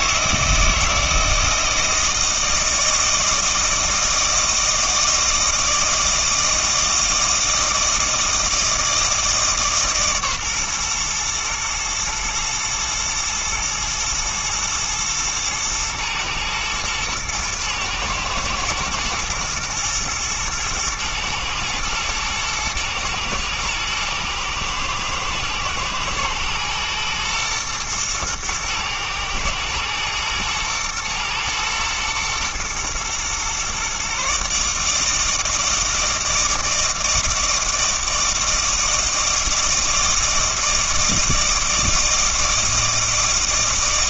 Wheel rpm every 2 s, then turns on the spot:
160, 160, 160, 160, 160, 130, 120, 110, 110, 120, 120, 110, 120, 120, 110, 110, 120, 150, 160, 160, 160, 160.
none